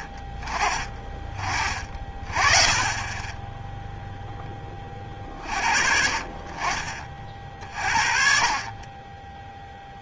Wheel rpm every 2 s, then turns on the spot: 30, 30, 0, 40, 50.
none